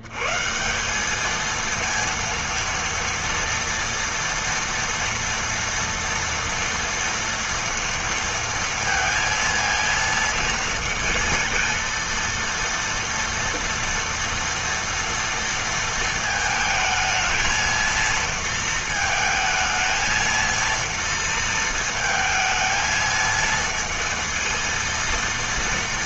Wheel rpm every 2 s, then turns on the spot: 90, 230, 230, 230, 230, 230, 230, 230, 220, 230, 230, 220, 230.
none